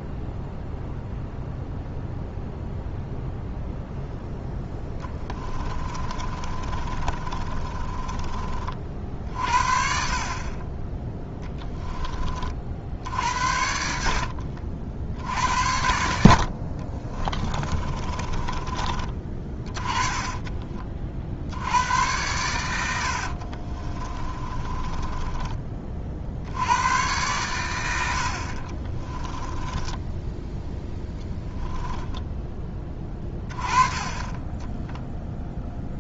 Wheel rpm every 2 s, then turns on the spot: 0, 0, 10, 30, 40, 20, 60, 60, 40, 30, 40, 90, 20, 90, 30, 10, 10, 10.
4-8 16-18 22-26 28-30